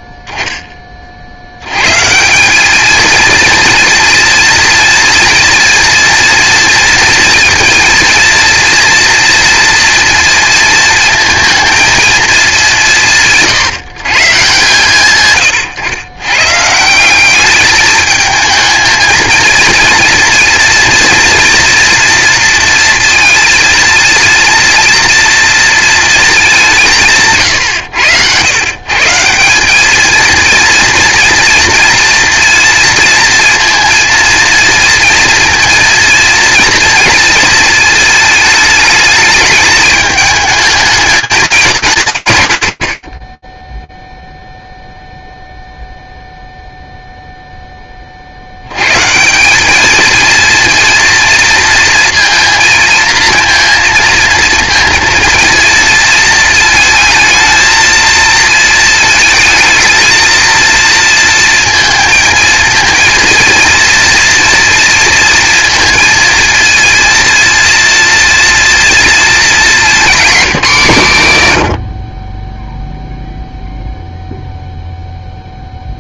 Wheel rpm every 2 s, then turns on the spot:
10, 190, 230, 230, 230, 230, 200, 120, 140, 220, 230, 230, 230, 200, 120, 230, 230, 230, 230, 220, 210, 110, 0, 0, 120, 230, 230, 230, 220, 220, 230, 230, 230, 230, 230, 170, 0, 0.
none